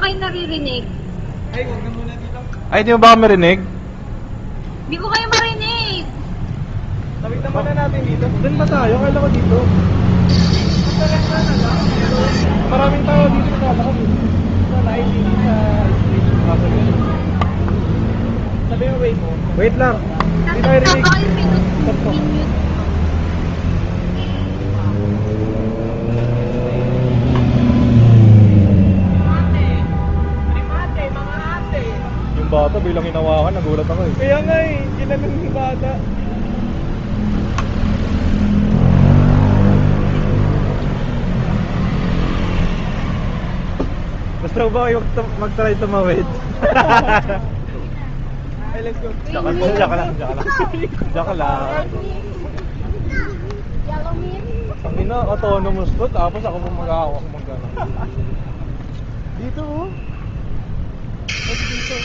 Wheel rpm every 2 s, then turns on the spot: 0, 0, 0, 0, 0, 0, 0, 0, 0, 0, 0, 0, 0, 0, 0, 0, 0, 0, 0, 0, 0, 0, 0, 0, 0, 0, 0, 0, 0, 0, 0.
none